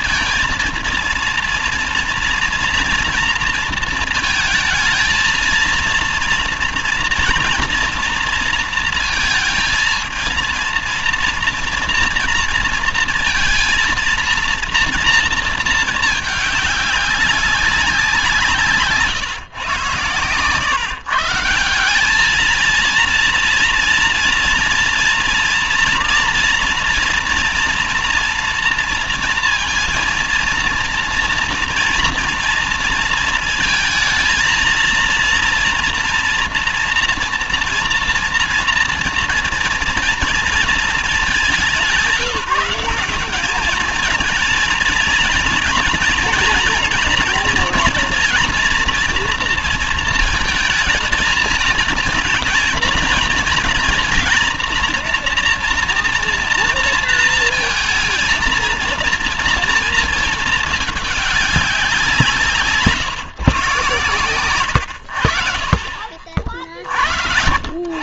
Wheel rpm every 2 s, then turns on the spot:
230, 240, 220, 230, 230, 230, 230, 230, 210, 170, 130, 220, 230, 240, 240, 230, 230, 230, 240, 240, 230, 190, 230, 230, 230, 220, 230, 240, 230, 230, 220, 170, 120, 40.
66-68